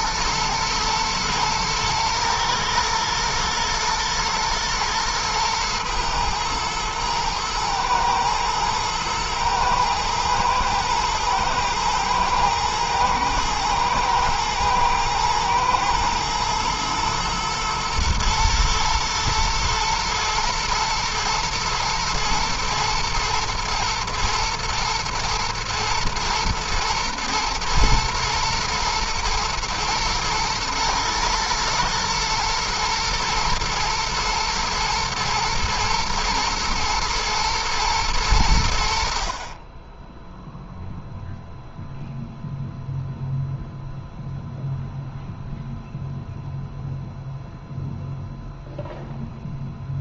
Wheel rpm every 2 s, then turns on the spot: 120, 110, 110, 110, 110, 110, 110, 110, 110, 110, 120, 110, 120, 120, 110, 110, 120, 120, 120, 50, 0, 0, 0, 0, 0.
none